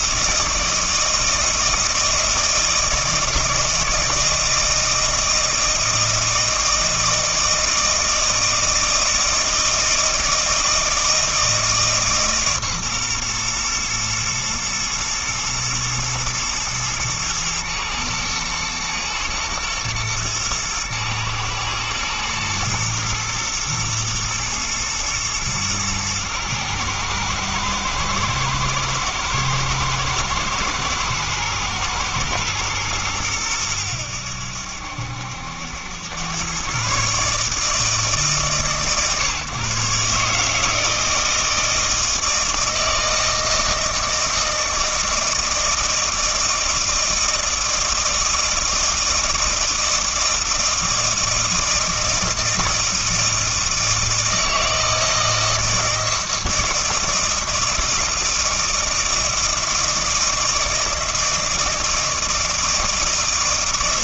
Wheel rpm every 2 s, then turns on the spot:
160, 160, 160, 160, 160, 160, 130, 110, 110, 110, 110, 110, 110, 110, 110, 110, 110, 70, 120, 140, 160, 160, 160, 160, 160, 160, 160, 160, 160, 160, 160, 160.
none